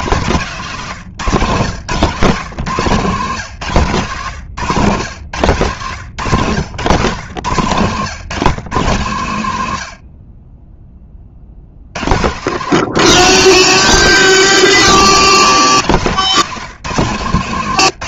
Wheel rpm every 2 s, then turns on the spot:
160, 160, 130, 140, 150, 20, 140, 150, 170.
none